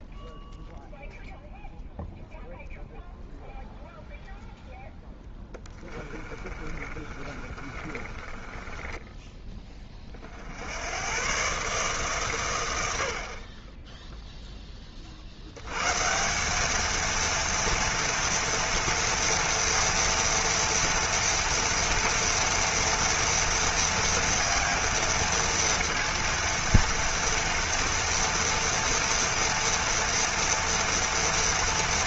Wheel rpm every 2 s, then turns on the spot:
0, 0, 0, 30, 10, 90, 80, 30, 220, 230, 230, 230, 230, 230, 230, 230.
6-10